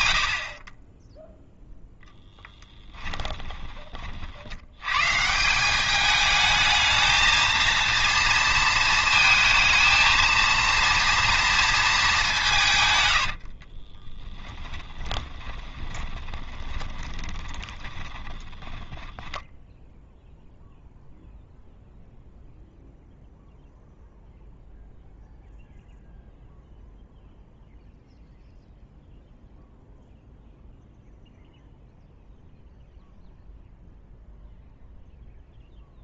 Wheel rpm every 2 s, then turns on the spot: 30, 10, 120, 220, 230, 230, 130, 20, 20, 10, 0, 0, 0, 0, 0, 0, 0, 0.
2-4 14-20